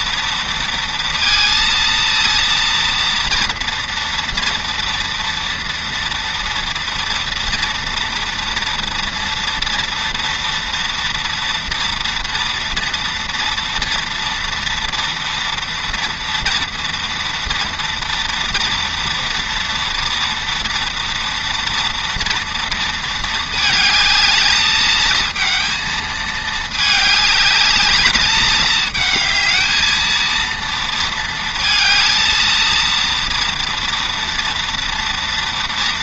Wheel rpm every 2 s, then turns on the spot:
230, 230, 240, 230, 230, 230, 230, 230, 230, 230, 230, 220, 220, 210, 220, 230, 230, 230.
none